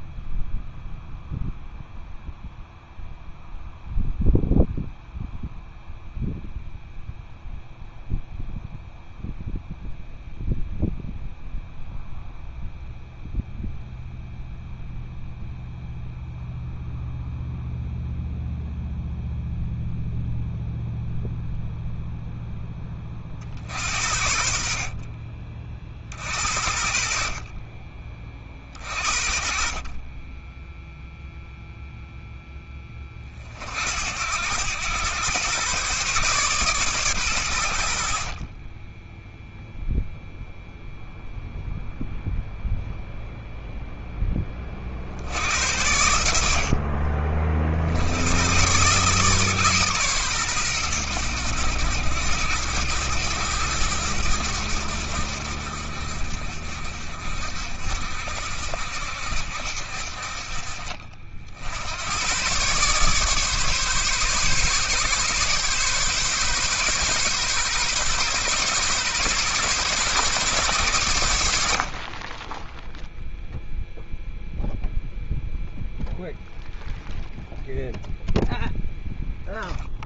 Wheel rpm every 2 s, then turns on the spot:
0, 0, 0, 0, 0, 0, 0, 0, 0, 0, 0, 30, 50, 60, 40, 0, 20, 110, 120, 20, 0, 0, 50, 50, 140, 110, 100, 80, 60, 70, 50, 140, 140, 130, 130, 110, 0, 0, 0, 0.
none